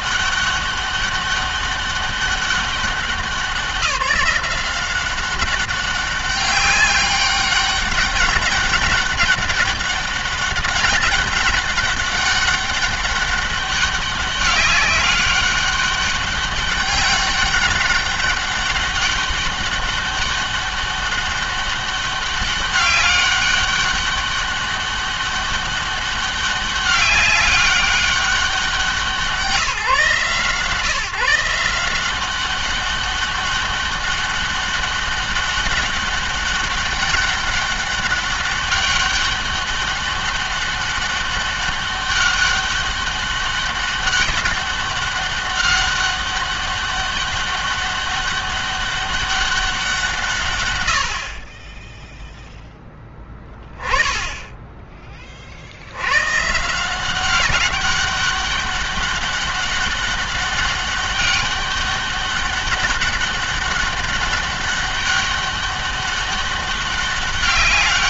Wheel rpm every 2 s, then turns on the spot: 200, 190, 170, 200, 200, 200, 200, 200, 200, 200, 200, 200, 200, 200, 190, 160, 190, 200, 200, 200, 200, 200, 200, 200, 200, 110, 0, 10, 160, 200, 200, 200, 200, 200.
none